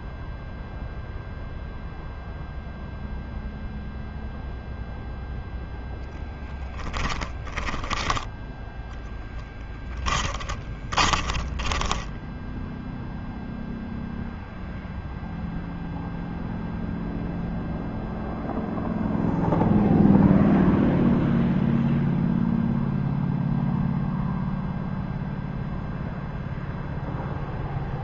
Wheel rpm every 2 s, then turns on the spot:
0, 0, 0, 10, 20, 30, 10, 0, 0, 0, 0, 0, 0, 0.
6-8 10-12